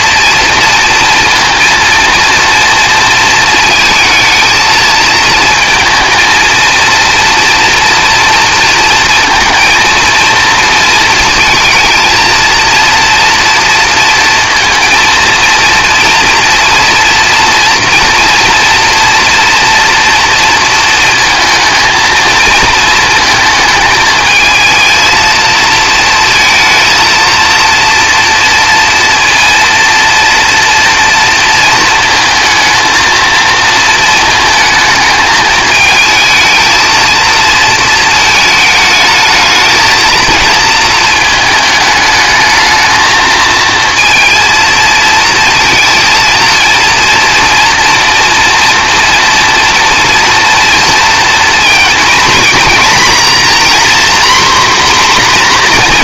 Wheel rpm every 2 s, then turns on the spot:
230, 230, 230, 230, 220, 230, 230, 230, 230, 230, 230, 230, 220, 220, 230, 230, 220, 220, 220, 220, 230, 220, 230, 230, 230, 230, 240, 250.
none